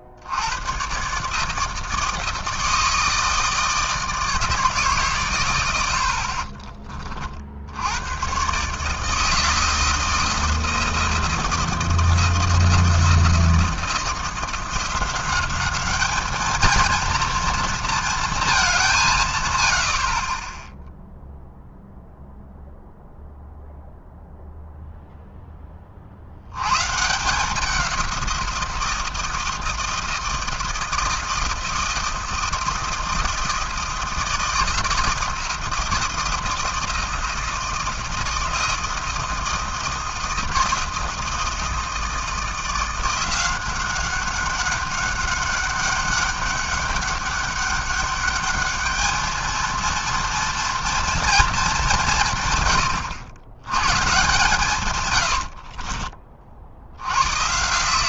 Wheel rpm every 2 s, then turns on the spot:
120, 160, 150, 30, 140, 160, 170, 180, 220, 200, 10, 0, 0, 110, 170, 160, 160, 160, 160, 160, 160, 170, 200, 200, 210, 230, 120, 140, 70.
none